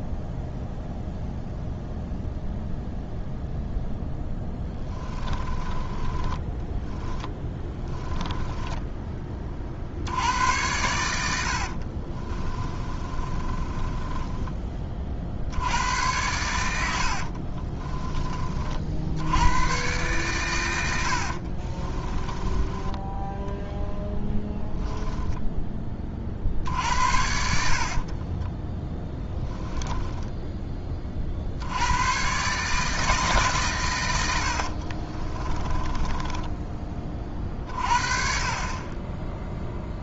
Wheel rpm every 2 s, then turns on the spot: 0, 0, 10, 10, 10, 90, 30, 20, 80, 50, 90, 20, 10, 60, 10, 20, 150, 50, 20, 30.
4-10 12-14 16-18 20-30 34-36